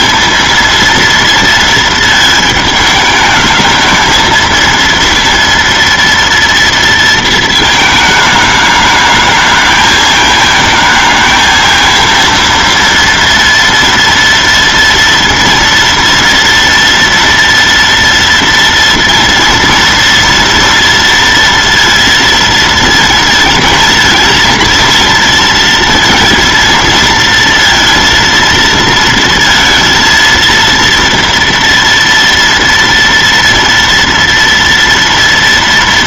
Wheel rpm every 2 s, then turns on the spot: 230, 220, 230, 230, 210, 220, 230, 230, 230, 230, 230, 230, 230, 230, 230, 230, 230, 230.
none